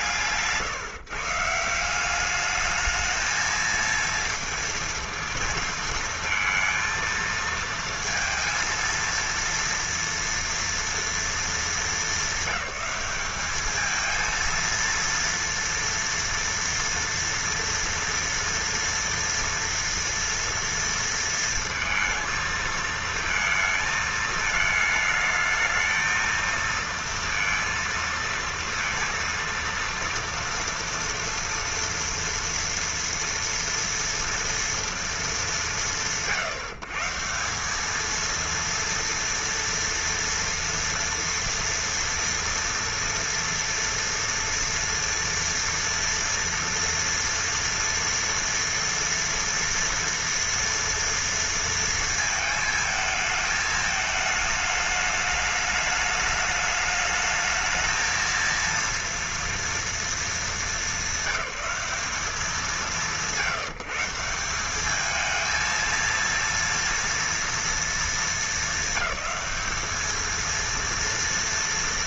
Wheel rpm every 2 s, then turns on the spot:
150, 210, 230, 230, 230, 230, 200, 230, 230, 240, 230, 230, 220, 230, 230, 230, 240, 230, 140, 230, 230, 230, 230, 230, 230, 230, 220, 210, 210, 230, 220, 190, 190, 230, 210, 230.
none